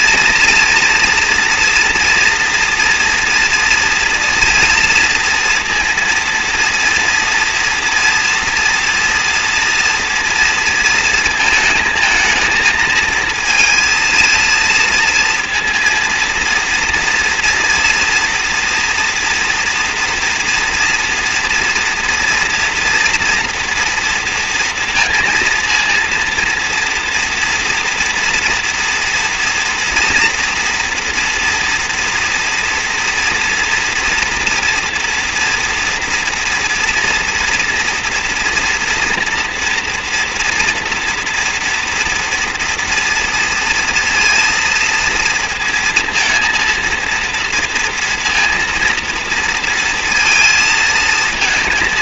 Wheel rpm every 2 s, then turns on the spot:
230, 230, 230, 230, 240, 230, 220, 230, 230, 230, 230, 240, 230, 230, 240, 230, 230, 230, 230, 230, 230, 230, 230, 230, 230, 230.
none